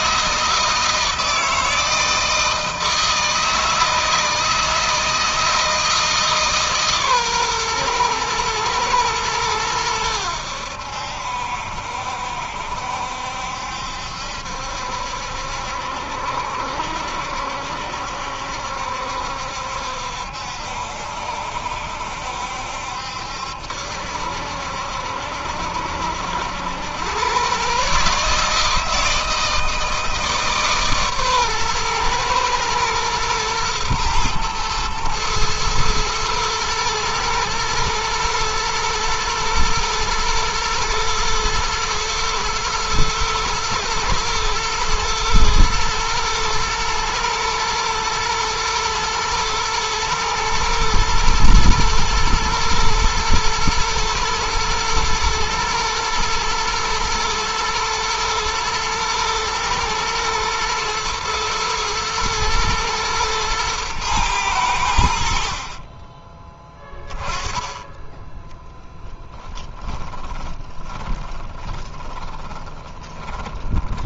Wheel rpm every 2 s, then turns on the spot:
160, 160, 160, 140, 110, 80, 70, 70, 70, 70, 70, 70, 70, 90, 160, 140, 120, 120, 110, 120, 120, 110, 120, 120, 110, 110, 120, 120, 110, 110, 120, 110, 80, 20, 20, 20, 10.
68-74